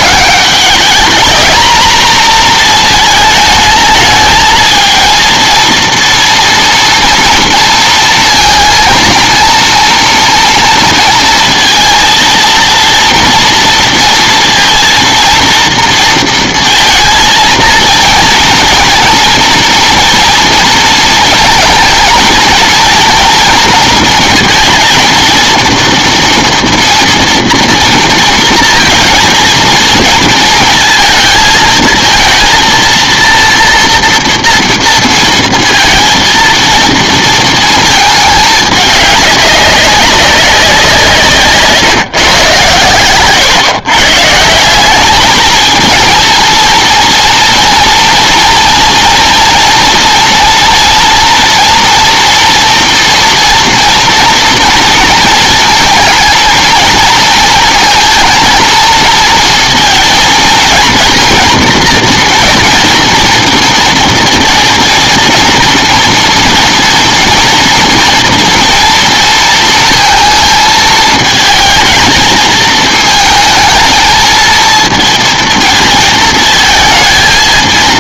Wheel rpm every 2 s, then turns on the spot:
210, 230, 220, 230, 230, 230, 230, 230, 230, 230, 230, 230, 230, 230, 230, 230, 230, 230, 230, 210, 190, 120, 170, 230, 230, 230, 230, 230, 230, 230, 230, 230, 230, 230, 230, 220, 220, 220, 220.
none